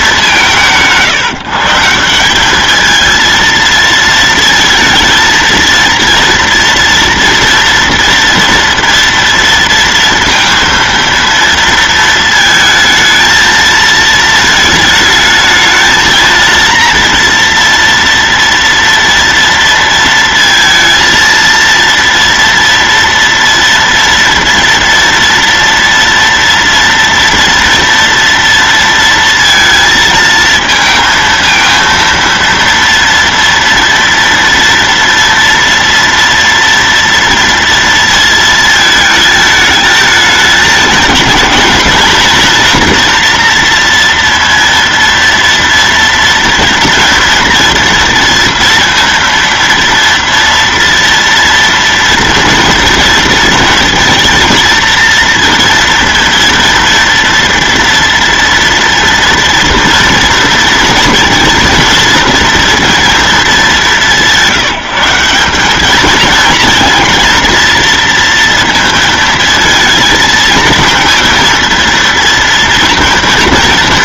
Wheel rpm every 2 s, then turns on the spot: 170, 220, 230, 230, 230, 230, 220, 220, 230, 230, 230, 230, 230, 230, 230, 220, 230, 230, 230, 220, 220, 240, 230, 240, 230, 230, 230, 230, 230, 230, 230, 230, 170, 230, 230, 230, 230.
none